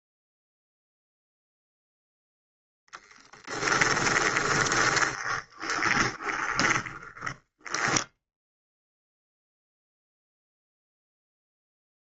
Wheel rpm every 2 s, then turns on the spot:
0, 10, 20, 10, 0, 0.
2-8